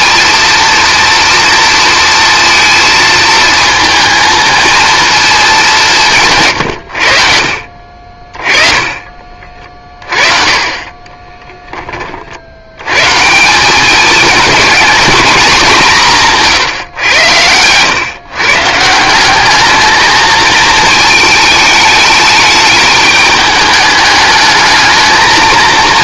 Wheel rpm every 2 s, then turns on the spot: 230, 230, 230, 120, 30, 30, 90, 210, 140, 150, 220, 220, 210.
8-10